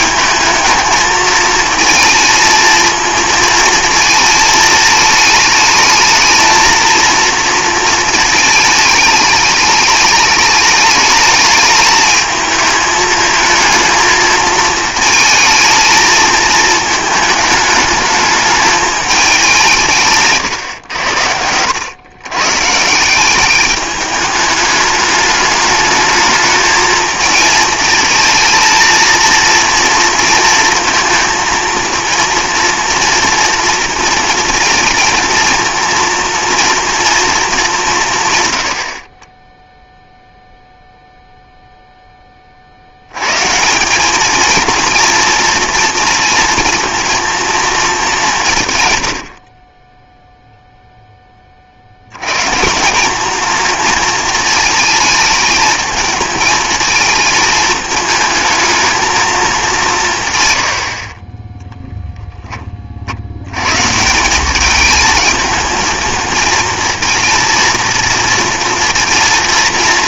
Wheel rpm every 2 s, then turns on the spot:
220, 230, 220, 220, 220, 210, 220, 220, 220, 220, 120, 130, 210, 220, 230, 230, 230, 230, 230, 100, 0, 60, 220, 230, 140, 0, 170, 220, 220, 220, 120, 20, 200, 230, 230.
20-22